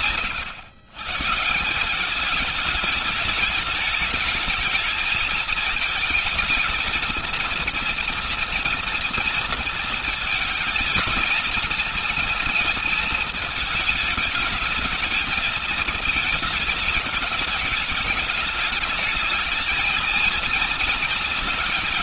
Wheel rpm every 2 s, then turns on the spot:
130, 210, 220, 220, 230, 220, 220, 220, 210, 210, 230.
none